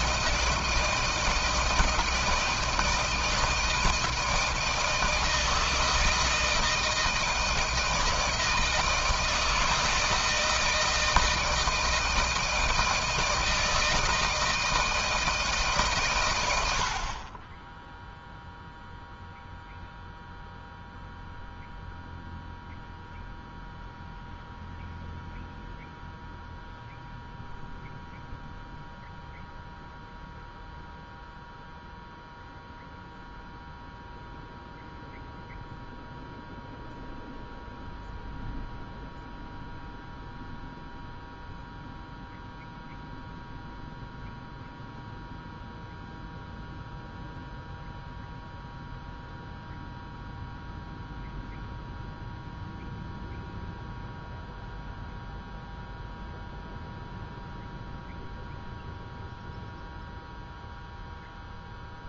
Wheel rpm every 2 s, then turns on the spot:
160, 160, 160, 160, 160, 160, 160, 160, 90, 0, 0, 0, 0, 0, 0, 0, 0, 0, 0, 0, 0, 0, 0, 0, 0, 0, 0, 0, 0, 0, 0.
none